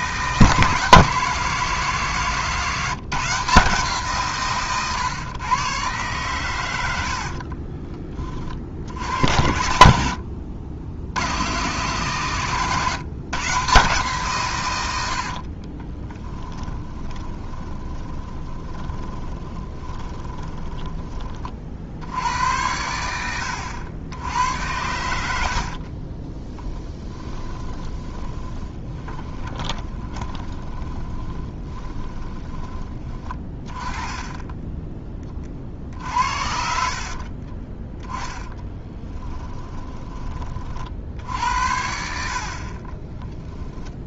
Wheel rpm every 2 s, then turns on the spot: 160, 170, 130, 100, 60, 80, 140, 100, 20, 20, 20, 80, 100, 20, 20, 20, 20, 10, 60, 10, 50, 30.
4-6 16-22 26-32 36-40